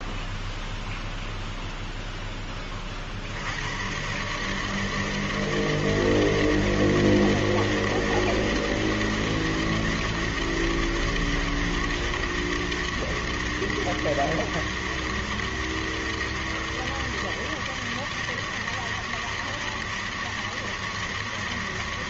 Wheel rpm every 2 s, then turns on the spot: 0, 10, 140, 160, 160, 160, 160, 160, 160, 160, 160.
none